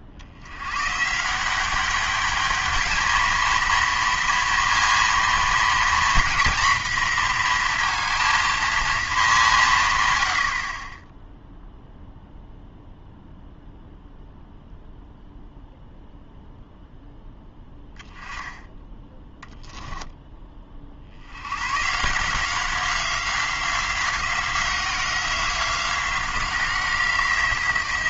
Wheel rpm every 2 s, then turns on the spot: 90, 210, 230, 230, 230, 40, 0, 0, 0, 10, 20, 170, 180, 180.
none